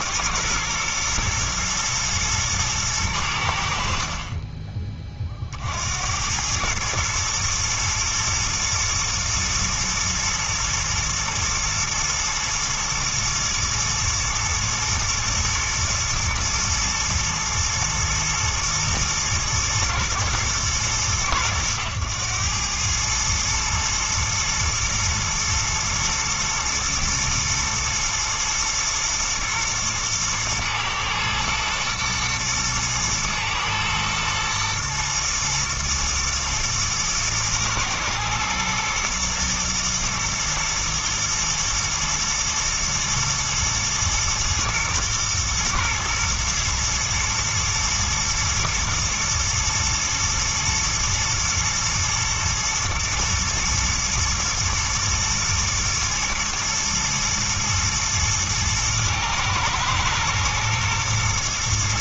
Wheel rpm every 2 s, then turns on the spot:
120, 110, 20, 110, 120, 120, 120, 120, 110, 120, 110, 110, 110, 120, 120, 110, 120, 120, 110, 120, 120, 120, 110, 110, 120, 110, 110, 110, 110, 110, 110.
none